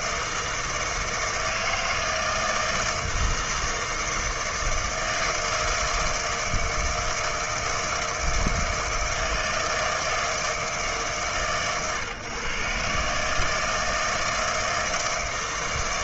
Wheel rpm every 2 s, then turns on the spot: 160, 160, 160, 160, 160, 160, 140, 160.
none